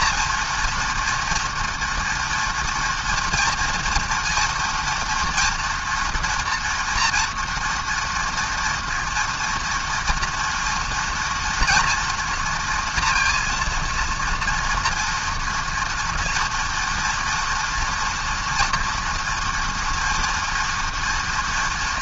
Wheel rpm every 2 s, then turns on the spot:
230, 230, 230, 230, 230, 230, 230, 230, 230, 240, 230.
none